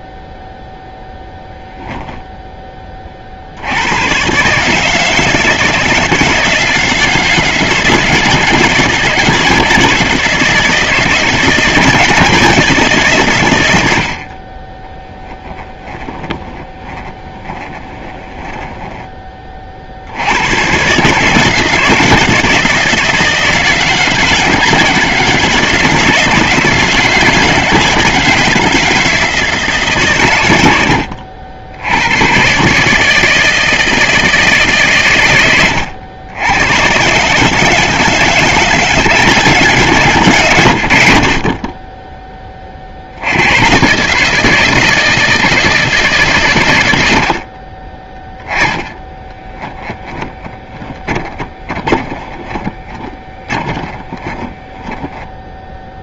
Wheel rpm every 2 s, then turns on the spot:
0, 20, 150, 160, 160, 160, 150, 40, 30, 20, 130, 160, 160, 160, 160, 90, 150, 130, 120, 170, 70, 50, 160, 100, 30, 20, 30, 10.
14-18 30-32 48-56